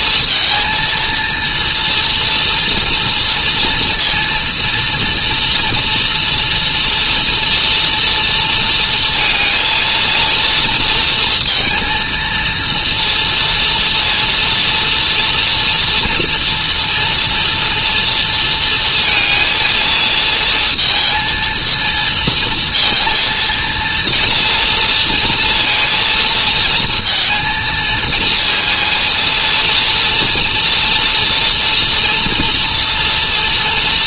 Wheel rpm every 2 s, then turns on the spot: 230, 230, 230, 240, 230, 230, 230, 230, 240, 230, 230, 230, 230, 230, 230, 230, 230.
none